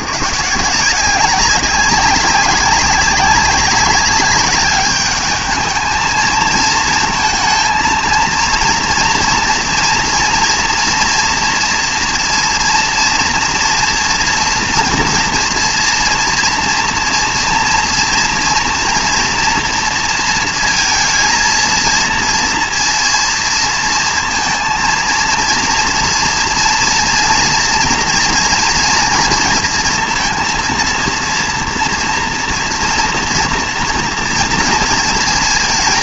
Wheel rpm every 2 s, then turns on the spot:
170, 190, 200, 230, 230, 230, 230, 230, 230, 230, 230, 230, 230, 230, 240, 230, 230, 230.
none